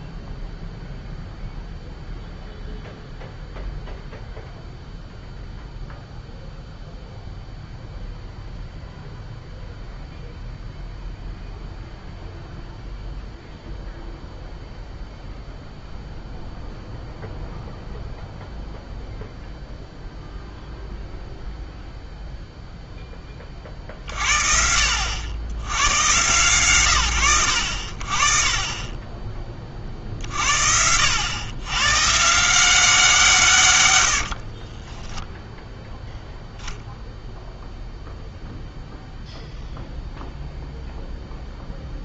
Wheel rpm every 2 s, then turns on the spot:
0, 0, 0, 0, 0, 0, 0, 0, 0, 0, 0, 0, 70, 120, 30, 70, 170, 20, 0, 0, 0.
34-36